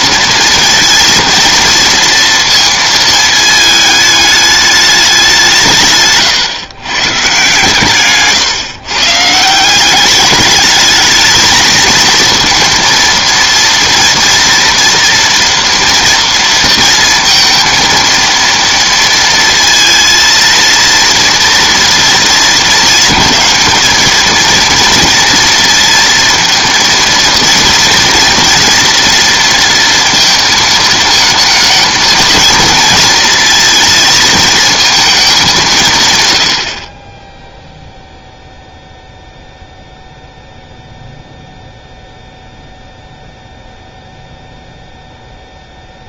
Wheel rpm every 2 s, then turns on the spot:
230, 230, 210, 130, 130, 210, 230, 230, 230, 230, 230, 220, 230, 230, 230, 220, 220, 230, 80, 0, 0, 0, 0.
none